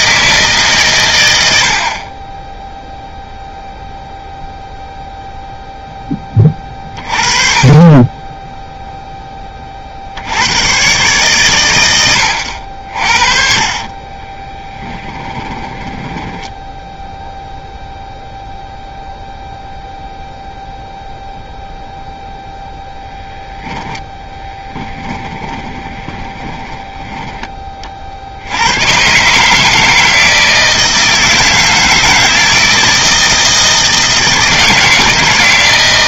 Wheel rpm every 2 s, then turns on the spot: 130, 0, 0, 30, 0, 120, 70, 10, 0, 0, 0, 0, 10, 20, 100, 160, 160, 160.
12-16 24-26